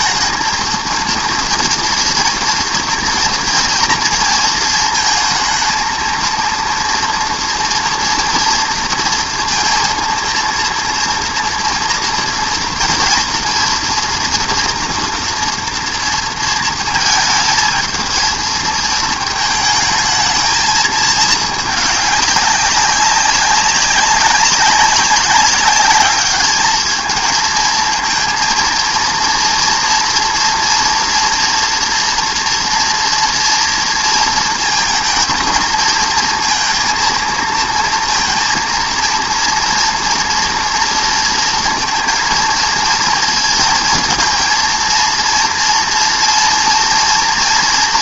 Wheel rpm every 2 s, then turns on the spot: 230, 230, 230, 220, 230, 230, 230, 230, 230, 220, 220, 220, 200, 200, 220, 230, 230, 230, 230, 230, 230, 230, 230, 230.
none